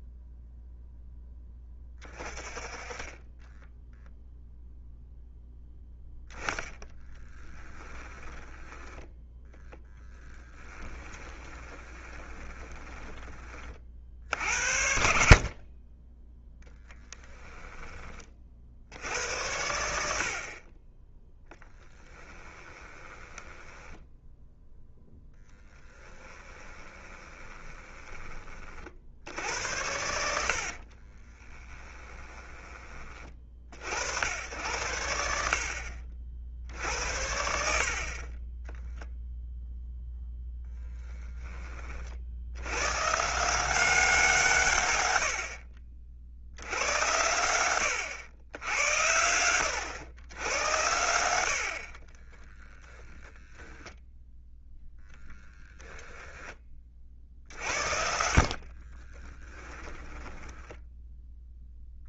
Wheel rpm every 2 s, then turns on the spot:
0, 20, 0, 10, 10, 10, 20, 70, 10, 70, 20, 10, 0, 20, 60, 40, 30, 80, 70, 0, 10, 120, 110, 100, 90, 80, 0, 0, 40, 40, 10.
8-14 16-18 22-24 26-28 30-32 58-60